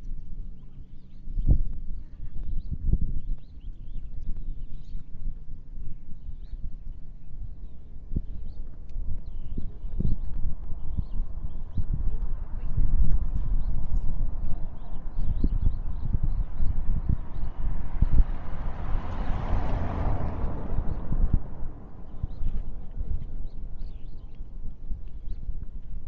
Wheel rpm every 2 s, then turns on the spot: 0, 0, 0, 0, 0, 0, 0, 0, 0, 0, 0, 0, 0.
none